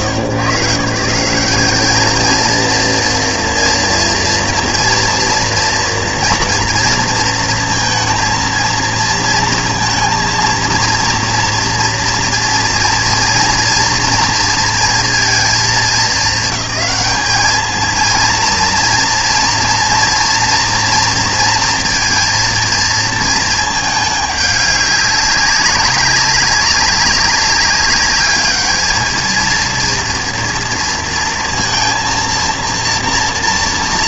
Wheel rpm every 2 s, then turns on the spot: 150, 230, 230, 230, 230, 230, 230, 230, 210, 230, 230, 220, 200, 190, 220, 230, 240.
none